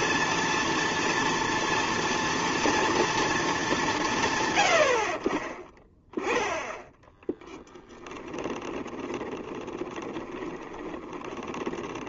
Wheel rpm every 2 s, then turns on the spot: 230, 230, 100, 10, 20, 20.
8-12